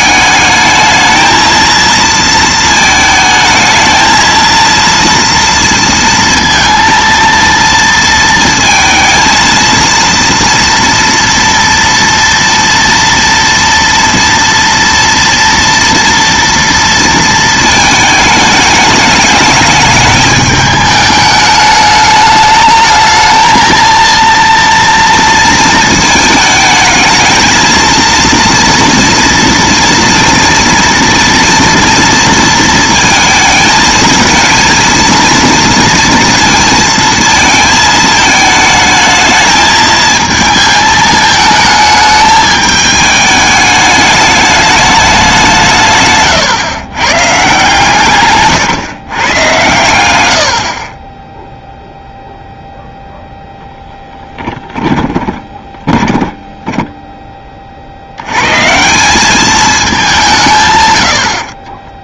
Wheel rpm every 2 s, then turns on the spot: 220, 220, 230, 230, 230, 230, 230, 230, 230, 210, 220, 210, 230, 220, 230, 230, 230, 230, 230, 220, 220, 210, 210, 120, 140, 50, 0, 10, 10, 140, 150.
54-58